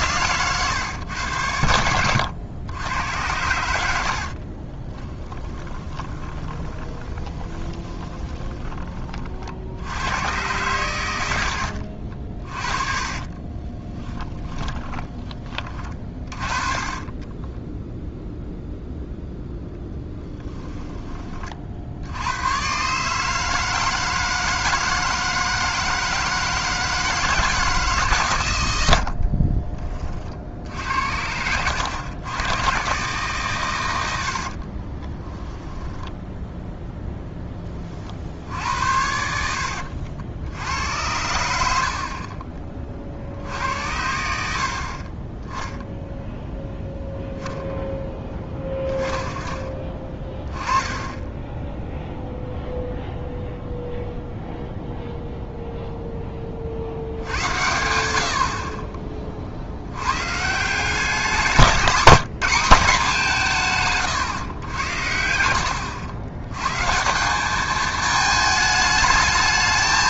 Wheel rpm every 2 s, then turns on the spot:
110, 100, 30, 20, 20, 100, 30, 20, 40, 0, 10, 110, 160, 160, 110, 60, 110, 50, 10, 70, 80, 40, 60, 0, 20, 10, 0, 0, 30, 50, 170, 190, 100, 100, 220.
4-8 12-16 34-36